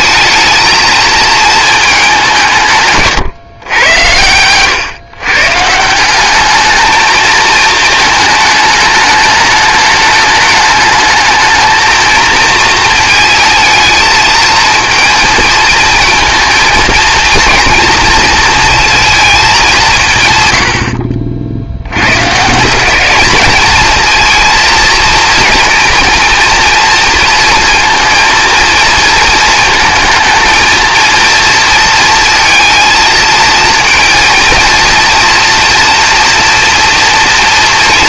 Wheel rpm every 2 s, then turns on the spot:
220, 130, 130, 220, 210, 210, 220, 230, 230, 230, 70, 190, 230, 230, 230, 230, 230, 230, 240.
none